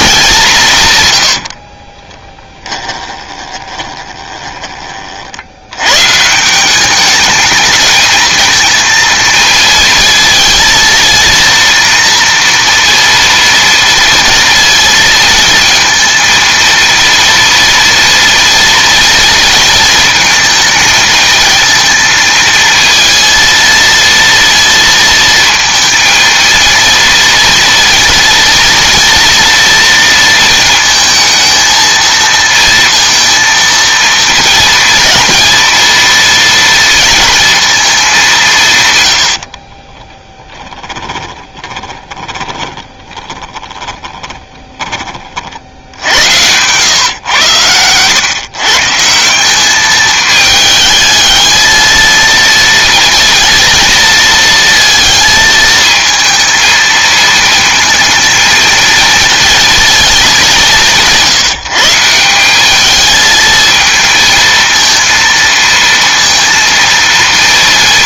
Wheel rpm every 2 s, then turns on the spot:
160, 10, 20, 180, 220, 230, 230, 230, 230, 230, 230, 230, 230, 230, 230, 230, 230, 220, 230, 160, 10, 20, 10, 110, 140, 220, 230, 230, 230, 220, 180, 190, 230, 230.
2-4 40-46